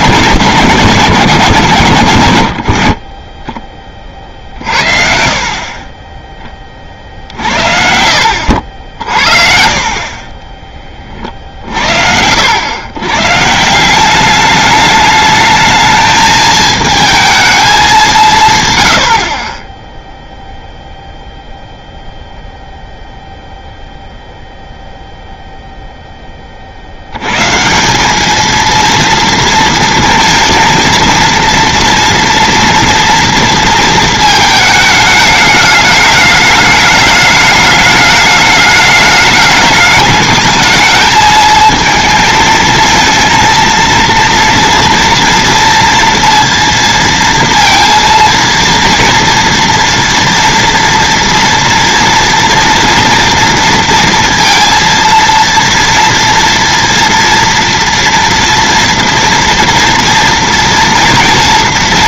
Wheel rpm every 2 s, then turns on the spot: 160, 60, 60, 20, 60, 30, 100, 200, 220, 120, 0, 0, 0, 50, 230, 230, 230, 220, 210, 210, 220, 230, 230, 230, 230, 230, 230, 230, 230, 230, 230.
2-4